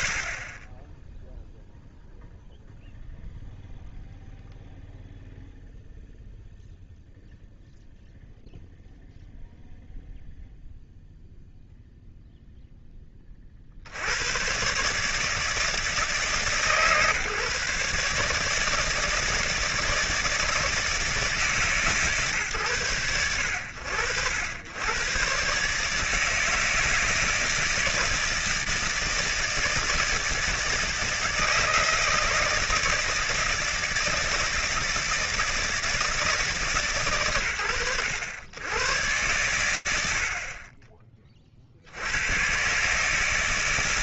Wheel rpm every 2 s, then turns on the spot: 0, 0, 0, 0, 0, 0, 10, 140, 150, 160, 160, 110, 120, 160, 160, 160, 160, 160, 120, 100, 30, 160.
none